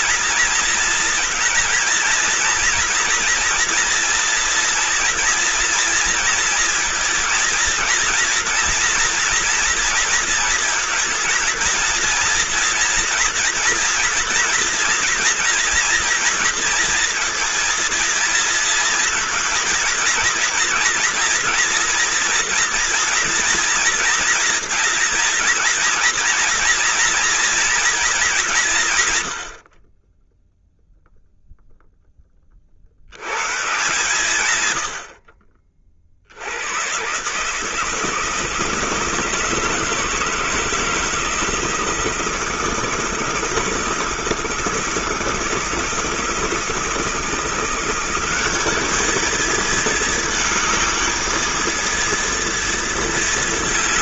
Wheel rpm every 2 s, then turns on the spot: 220, 230, 240, 230, 230, 230, 230, 240, 230, 230, 230, 230, 230, 230, 150, 0, 40, 110, 100, 160, 160, 160, 160, 160, 210, 220, 230.
none